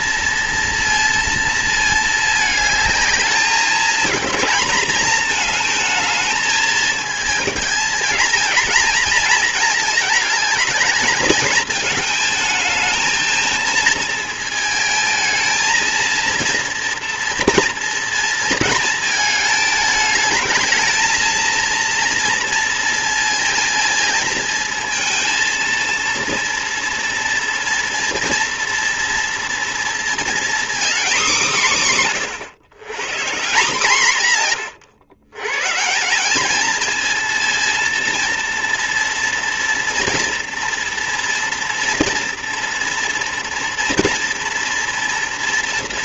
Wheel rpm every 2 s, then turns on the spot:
230, 210, 220, 220, 230, 220, 220, 220, 230, 220, 220, 230, 230, 230, 230, 240, 140, 120, 220, 240, 240, 230, 230.
none